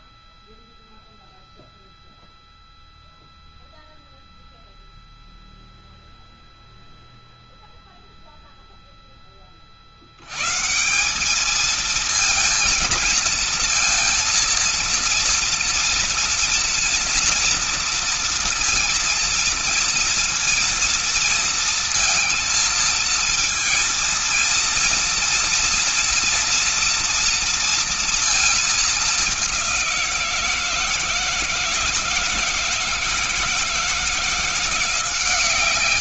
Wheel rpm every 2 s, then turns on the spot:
0, 0, 0, 0, 0, 120, 230, 230, 230, 230, 230, 230, 230, 230, 230, 170, 160, 170.
none